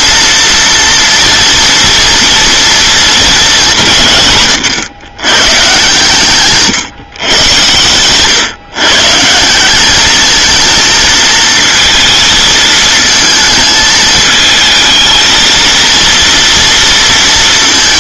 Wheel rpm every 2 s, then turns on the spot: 230, 230, 150, 130, 140, 220, 220, 220, 230.
none